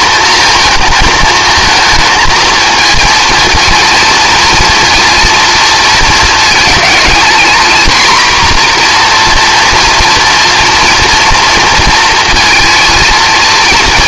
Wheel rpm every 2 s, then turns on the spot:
220, 230, 230, 220, 240, 230, 230.
none